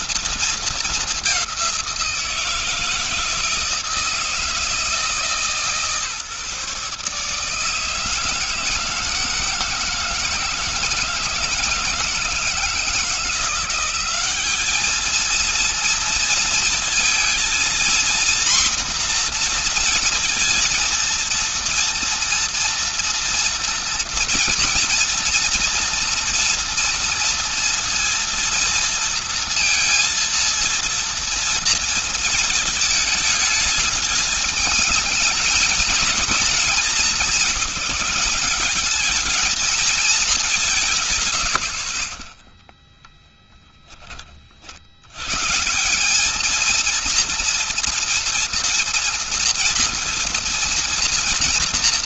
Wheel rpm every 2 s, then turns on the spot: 210, 160, 160, 150, 160, 160, 170, 220, 230, 240, 230, 230, 230, 230, 230, 230, 220, 220, 200, 210, 140, 10, 80, 230, 230, 230.
42-44